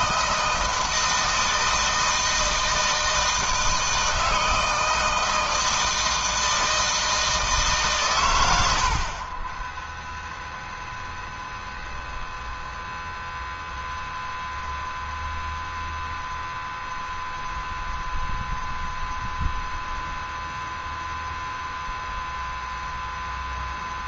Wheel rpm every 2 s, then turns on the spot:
160, 160, 160, 160, 100, 0, 0, 0, 0, 0, 0, 0.
none